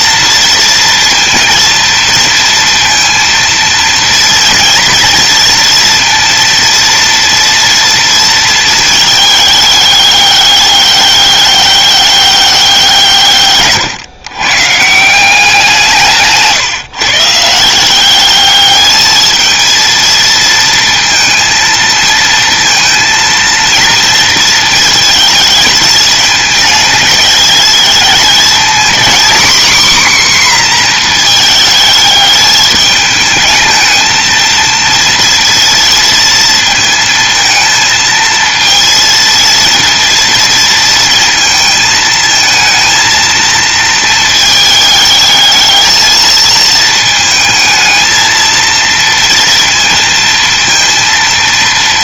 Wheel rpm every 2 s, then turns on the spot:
230, 230, 230, 230, 220, 200, 170, 160, 150, 220, 230, 220, 220, 220, 240, 240, 210, 230, 220, 230, 230, 230, 220, 220, 230, 230.
none